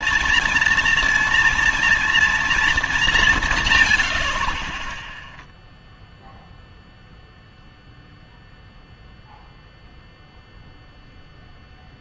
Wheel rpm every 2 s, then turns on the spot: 230, 230, 60, 0, 0, 0.
none